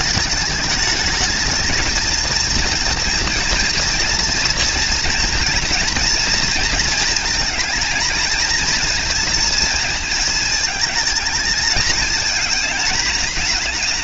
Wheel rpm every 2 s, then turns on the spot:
220, 230, 230, 230, 230, 220, 220.
none